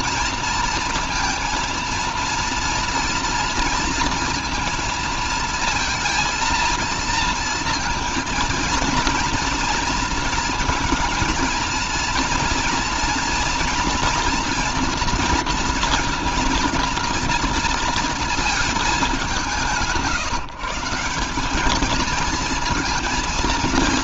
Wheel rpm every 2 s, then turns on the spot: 230, 230, 230, 230, 230, 230, 230, 230, 230, 210, 180, 230.
none